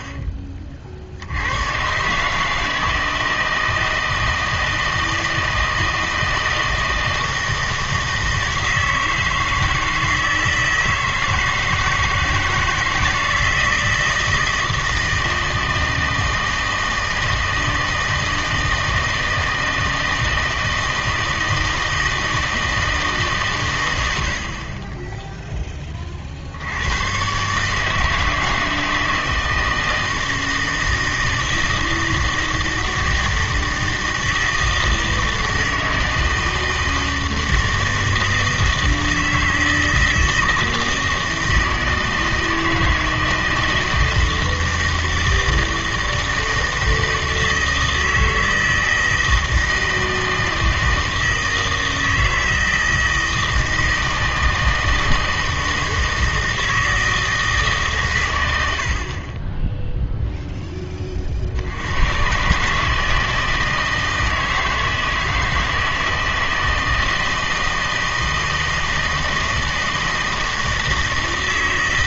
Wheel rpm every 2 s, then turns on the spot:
50, 160, 160, 160, 160, 160, 160, 160, 160, 160, 160, 160, 30, 90, 160, 160, 160, 160, 160, 160, 160, 160, 160, 160, 160, 160, 160, 160, 160, 60, 10, 150, 160, 160, 160, 160.
none